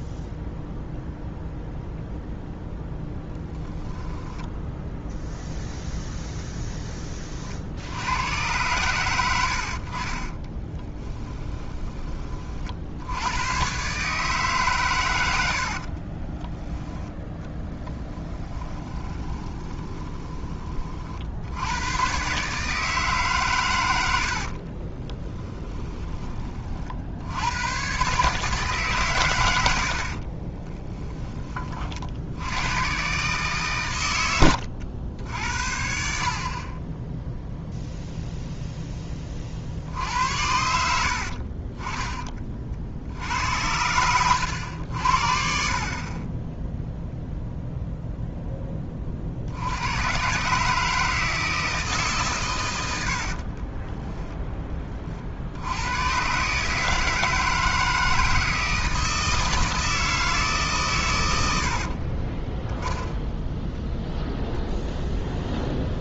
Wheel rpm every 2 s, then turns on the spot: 0, 0, 10, 10, 100, 20, 60, 130, 10, 20, 40, 150, 40, 50, 140, 20, 110, 80, 20, 0, 80, 50, 80, 0, 10, 150, 90, 30, 160, 160, 140, 10, 10.
4-6 10-12 18-20 24-26 30-32 40-42